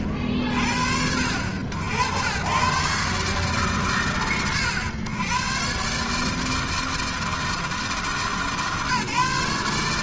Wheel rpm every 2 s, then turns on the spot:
50, 110, 110, 160, 150.
none